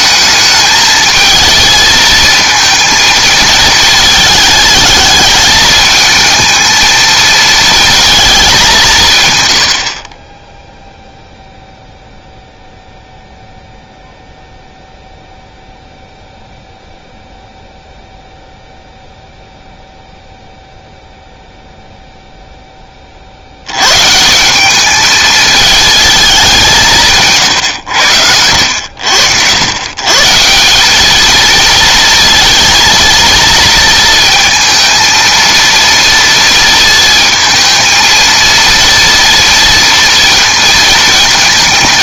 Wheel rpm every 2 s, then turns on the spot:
220, 230, 210, 220, 180, 0, 0, 0, 0, 0, 0, 10, 200, 190, 80, 190, 230, 230, 230, 230, 230.
none